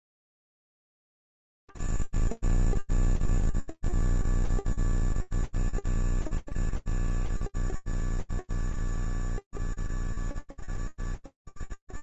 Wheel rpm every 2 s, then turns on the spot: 0, 0, 0, 0, 0, 0.
none